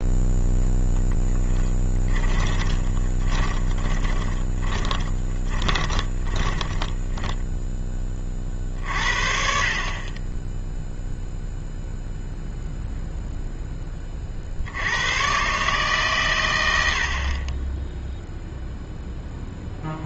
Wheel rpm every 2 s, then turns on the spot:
0, 20, 20, 20, 40, 10, 0, 70, 90, 0.
2-8